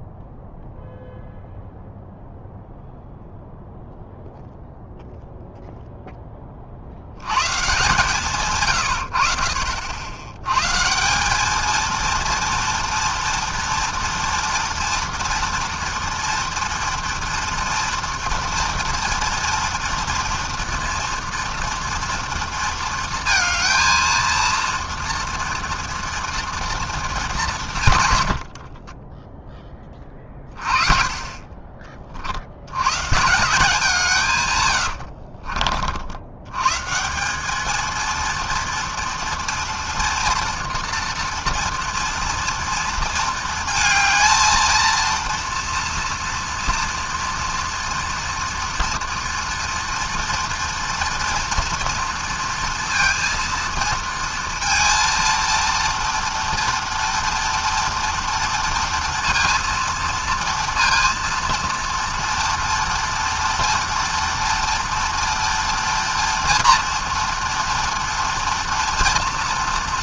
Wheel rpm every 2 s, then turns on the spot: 0, 0, 0, 30, 130, 120, 230, 230, 230, 230, 230, 230, 230, 230, 90, 30, 80, 120, 100, 230, 230, 230, 230, 230, 230, 230, 230, 230, 230, 230, 230, 230, 230, 230, 230.
28-30